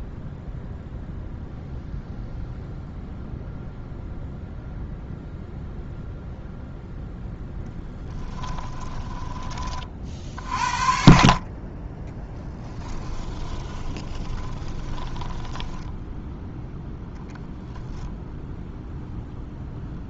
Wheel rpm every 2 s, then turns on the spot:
0, 0, 0, 0, 10, 40, 10, 20, 10, 10.
8-10 12-16